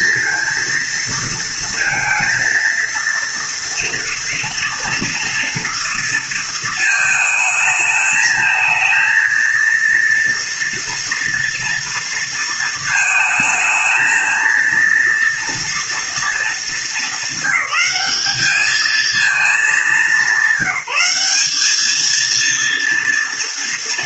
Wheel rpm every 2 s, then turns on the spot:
230, 230, 230, 220, 230, 230, 220, 230, 210, 220, 200, 230.
none